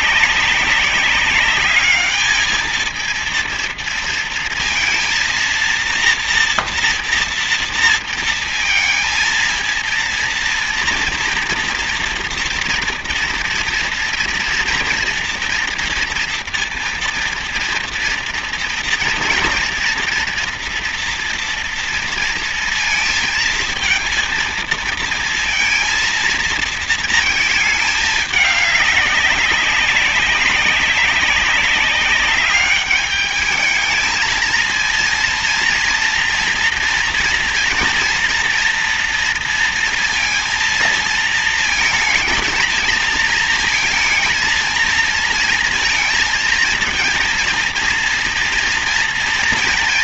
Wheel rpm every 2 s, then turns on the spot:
200, 220, 230, 240, 220, 230, 230, 230, 230, 230, 240, 230, 230, 220, 200, 200, 200, 230, 230, 230, 230, 220, 230, 220, 230.
none